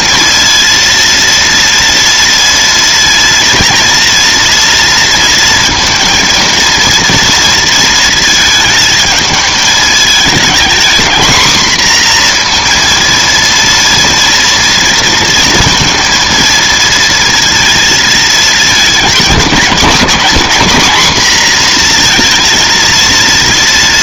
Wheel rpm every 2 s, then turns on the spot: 230, 230, 230, 230, 220, 230, 240, 230, 230, 220, 230, 230.
none